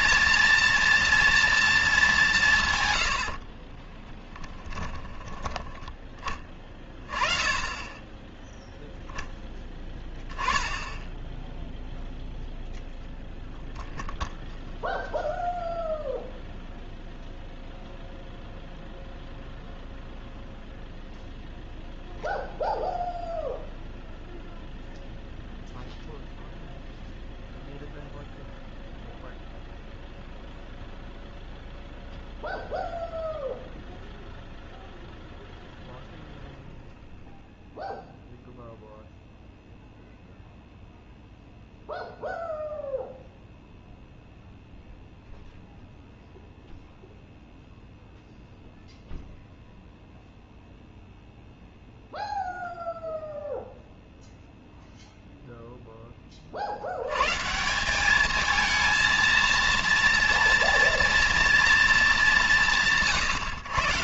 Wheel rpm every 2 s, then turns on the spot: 230, 90, 10, 30, 0, 10, 0, 0, 0, 0, 0, 0, 0, 0, 0, 0, 0, 0, 0, 0, 0, 0, 0, 0, 0, 0, 0, 0, 110, 220, 230, 150.
2-4